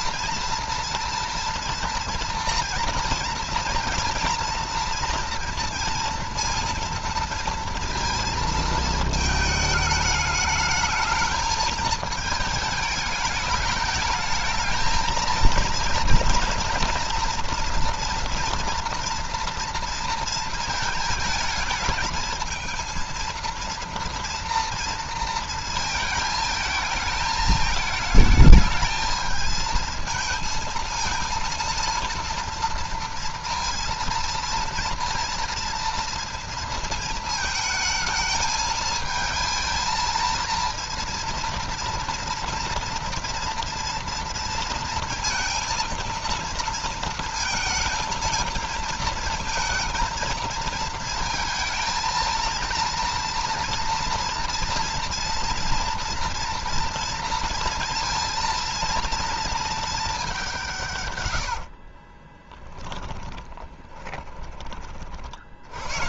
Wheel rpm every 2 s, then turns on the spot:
230, 230, 230, 230, 220, 220, 210, 220, 230, 230, 220, 220, 230, 220, 220, 230, 230, 230, 220, 220, 230, 240, 230, 230, 230, 230, 230, 230, 230, 230, 150, 10, 30.
60-64